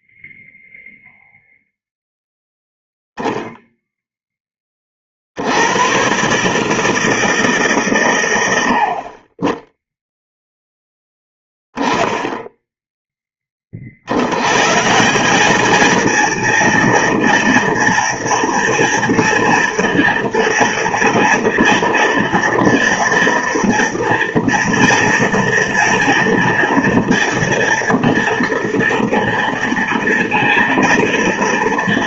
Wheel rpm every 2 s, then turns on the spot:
0, 0, 20, 140, 80, 0, 0, 120, 230, 230, 230, 230, 230, 230, 230, 230.
none